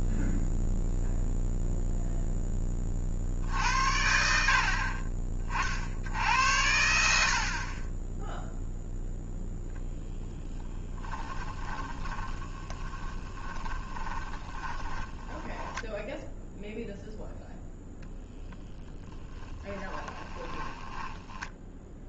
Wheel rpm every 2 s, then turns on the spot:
0, 10, 60, 80, 0, 10, 20, 10, 0, 10, 20.
12-16 18-22